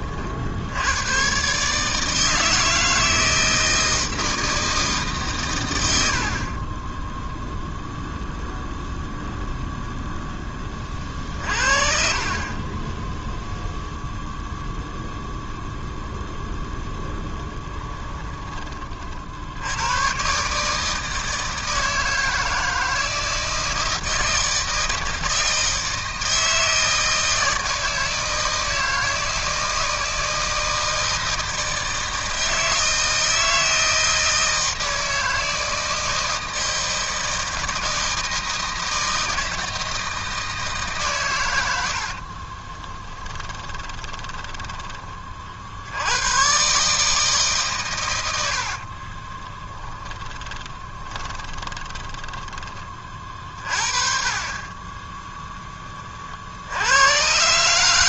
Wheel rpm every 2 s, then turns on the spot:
50, 160, 160, 40, 0, 10, 30, 0, 0, 20, 140, 160, 160, 160, 160, 160, 160, 160, 160, 160, 160, 40, 20, 110, 90, 10, 10, 40, 50.
42-46 50-54